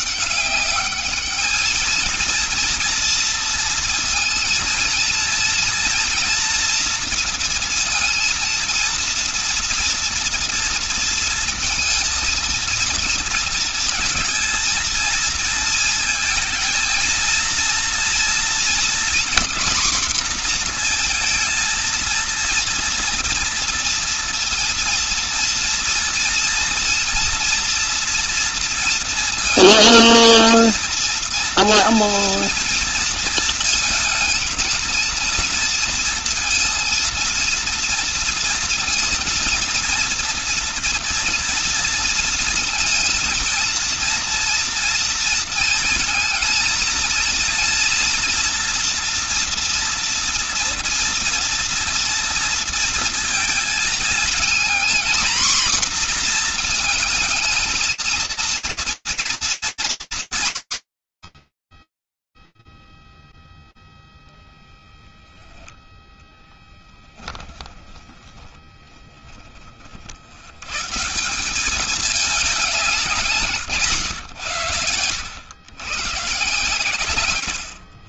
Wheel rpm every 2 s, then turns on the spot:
200, 230, 230, 230, 230, 230, 230, 230, 230, 240, 230, 230, 230, 230, 230, 230, 230, 230, 230, 230, 230, 230, 230, 230, 230, 230, 230, 240, 230, 230, 130, 0, 0, 10, 40, 190, 140, 110, 110.
66-68